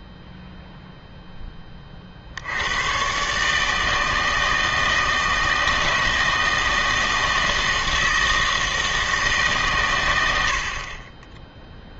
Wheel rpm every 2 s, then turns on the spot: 0, 80, 160, 160, 160, 100.
none